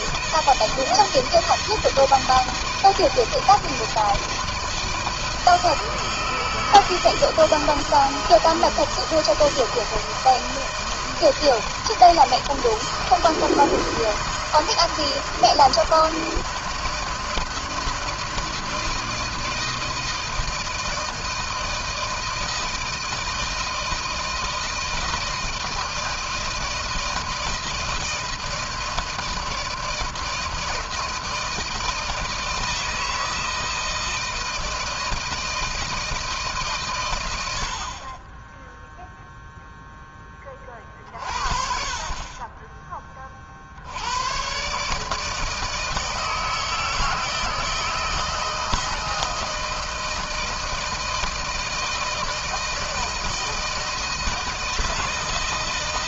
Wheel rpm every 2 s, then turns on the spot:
160, 160, 160, 160, 160, 160, 160, 160, 160, 160, 160, 160, 160, 160, 160, 160, 160, 160, 150, 10, 20, 30, 130, 160, 160, 160, 160, 160.
none